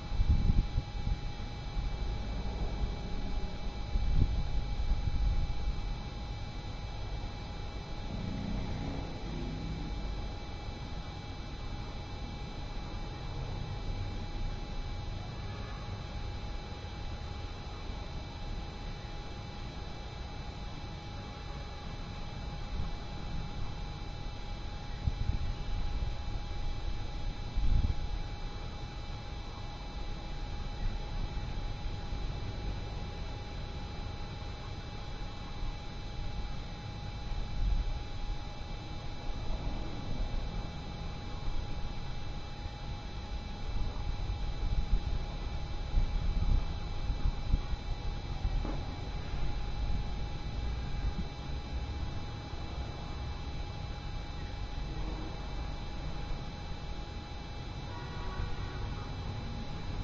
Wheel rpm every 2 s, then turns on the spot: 0, 0, 0, 0, 0, 0, 0, 0, 0, 0, 0, 0, 0, 0, 0, 0, 0, 0, 0, 0, 0, 0, 0, 0, 0, 0, 0, 0, 0, 0.
none